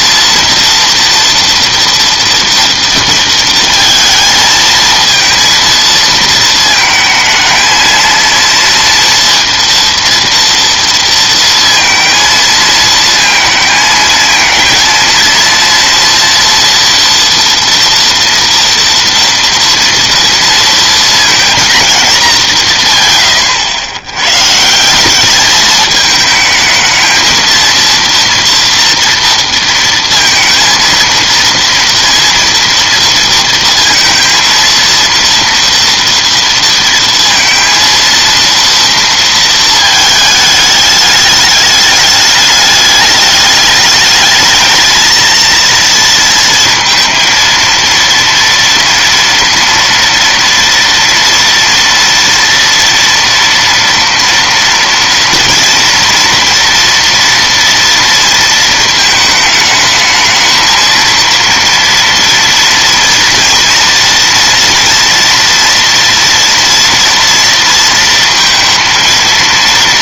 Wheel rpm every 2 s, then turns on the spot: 230, 230, 230, 220, 230, 230, 220, 240, 230, 230, 230, 100, 220, 230, 230, 230, 230, 230, 230, 220, 210, 210, 230, 230, 230, 240, 240, 230, 230, 220, 230, 240, 230, 230, 230.
none